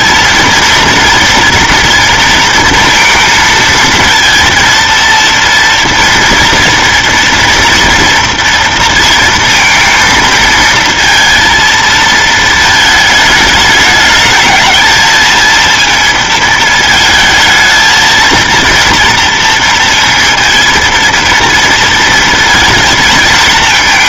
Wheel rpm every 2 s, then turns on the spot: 230, 230, 230, 230, 230, 230, 220, 220, 220, 230, 230, 230.
none